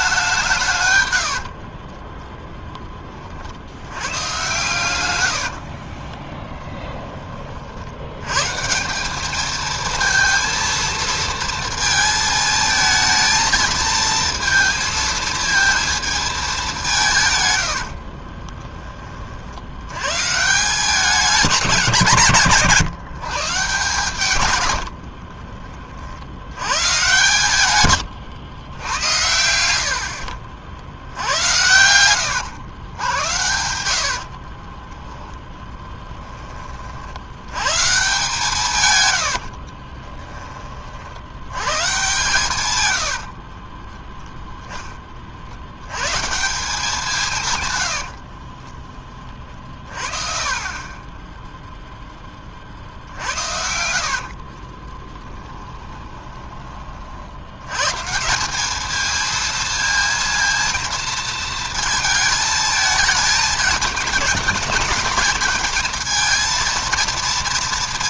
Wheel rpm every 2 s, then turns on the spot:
130, 20, 110, 10, 170, 230, 220, 220, 180, 20, 170, 140, 90, 120, 100, 70, 100, 20, 40, 130, 50, 110, 10, 170, 30, 20, 50, 20, 30, 210, 230, 220, 220, 230.
24-26 34-36 42-44 54-56